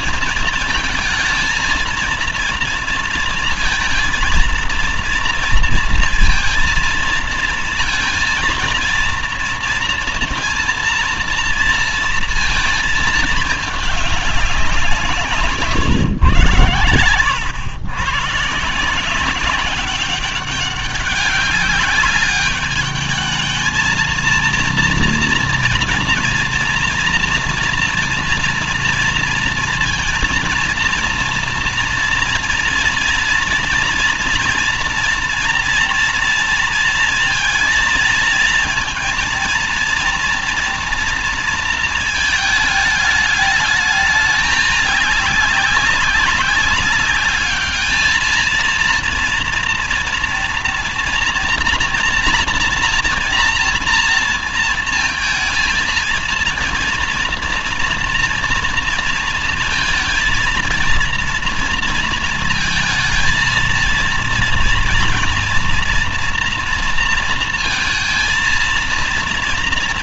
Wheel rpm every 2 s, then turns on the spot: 230, 230, 230, 230, 230, 230, 230, 190, 110, 160, 200, 210, 230, 230, 230, 230, 240, 230, 230, 230, 230, 210, 200, 190, 230, 230, 230, 230, 230, 230, 230, 230, 230, 230, 230.
none